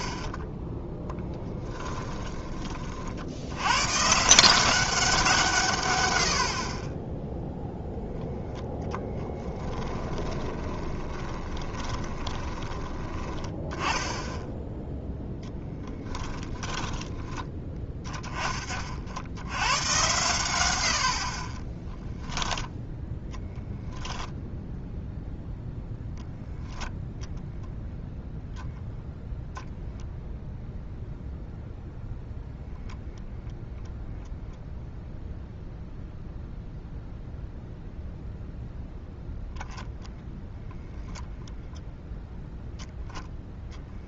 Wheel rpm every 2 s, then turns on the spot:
10, 40, 180, 50, 0, 10, 20, 10, 10, 40, 90, 0, 0, 0, 0, 0, 0, 0, 0, 0, 10, 0.
10-12 16-18 40-42